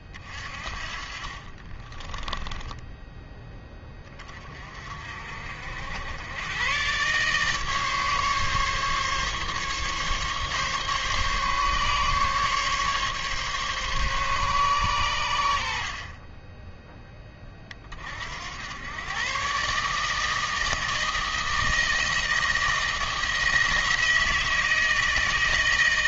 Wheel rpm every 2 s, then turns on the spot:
40, 10, 40, 110, 150, 140, 140, 130, 20, 80, 160, 160, 160.
2-4